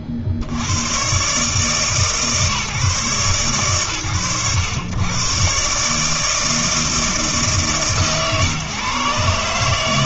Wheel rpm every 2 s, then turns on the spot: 50, 140, 100, 160, 130.
none